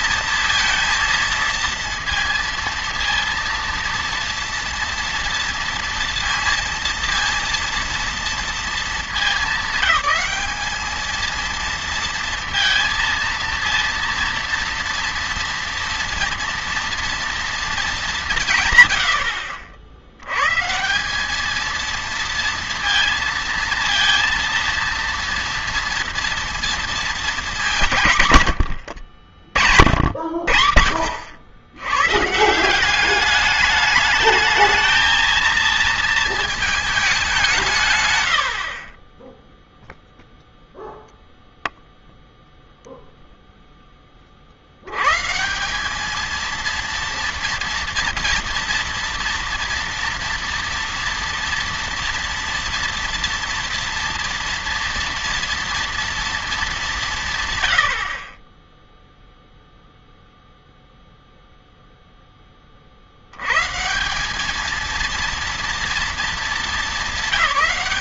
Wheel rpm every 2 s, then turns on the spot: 230, 230, 230, 230, 220, 220, 230, 230, 230, 120, 160, 230, 230, 230, 70, 60, 180, 220, 220, 50, 0, 0, 100, 230, 240, 240, 230, 230, 190, 10, 0, 40, 220, 220.
none